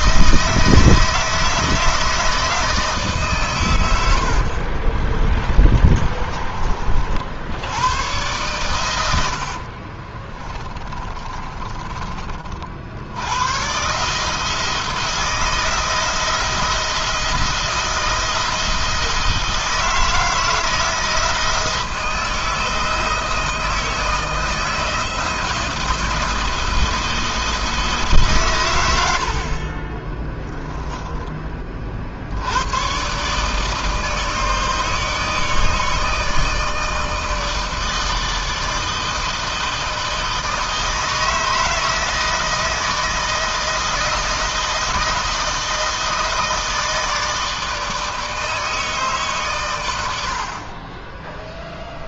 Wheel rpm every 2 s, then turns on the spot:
160, 150, 40, 40, 100, 30, 60, 160, 170, 160, 160, 160, 170, 170, 100, 10, 110, 150, 160, 160, 160, 160, 160, 160, 150, 40.
4-6 8-12 50-52